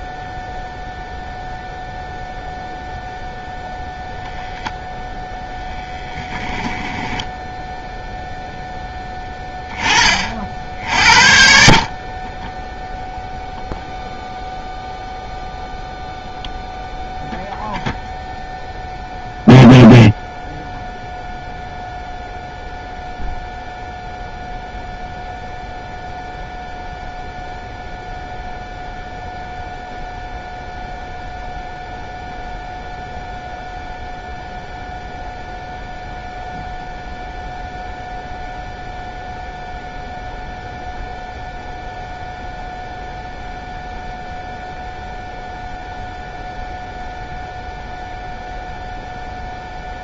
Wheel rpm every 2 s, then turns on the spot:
0, 0, 0, 10, 10, 60, 0, 0, 0, 0, 0, 0, 0, 0, 0, 0, 0, 0, 0, 0, 0, 0, 0, 0, 0.
none